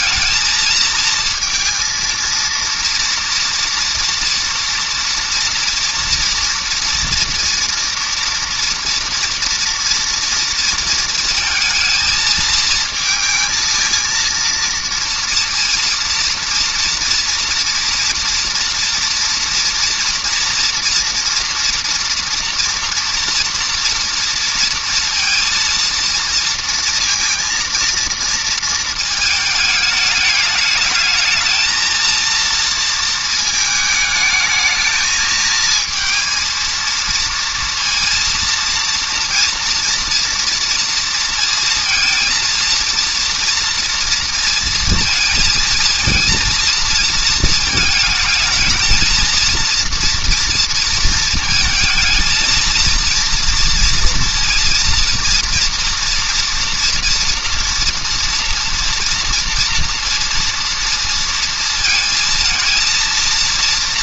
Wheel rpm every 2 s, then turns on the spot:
220, 230, 230, 230, 230, 240, 230, 230, 230, 230, 230, 230, 230, 230, 230, 210, 230, 220, 220, 230, 230, 230, 230, 230, 220, 230, 230, 230, 240, 230, 230, 230.
none